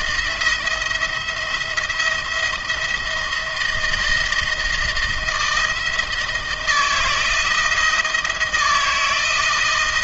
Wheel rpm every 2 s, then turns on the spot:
160, 170, 160, 160, 160.
none